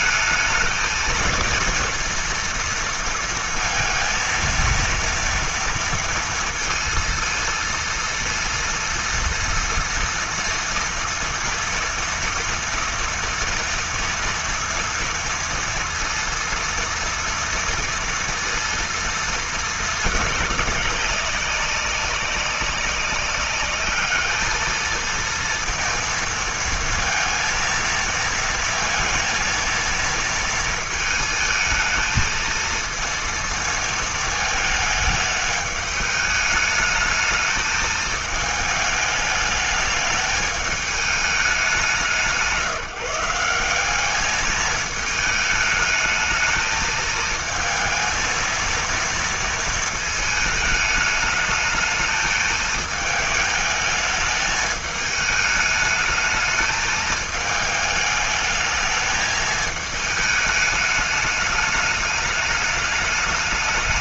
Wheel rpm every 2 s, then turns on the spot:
220, 230, 230, 230, 230, 230, 230, 230, 230, 230, 210, 190, 220, 230, 230, 220, 230, 210, 210, 210, 210, 170, 220, 220, 230, 220, 220, 210, 220, 220, 210, 210.
none